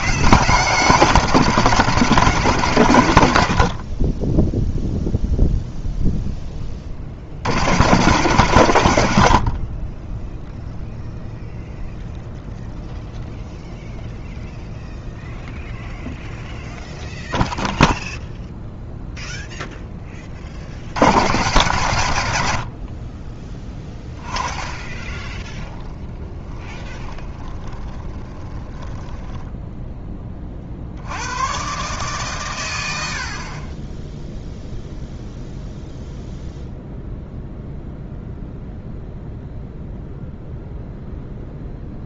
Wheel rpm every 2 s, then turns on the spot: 160, 140, 0, 30, 120, 0, 0, 0, 0, 0, 60, 70, 20, 20, 20, 50, 90, 0, 0, 0, 0.
24-30